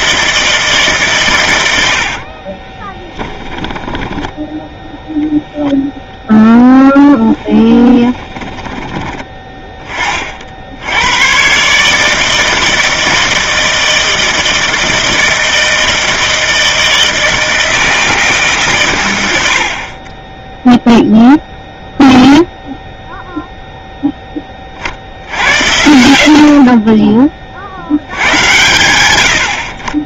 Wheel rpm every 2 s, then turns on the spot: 150, 30, 0, 0, 20, 80, 160, 160, 160, 130, 0, 0, 50, 30, 90.
2-4 8-10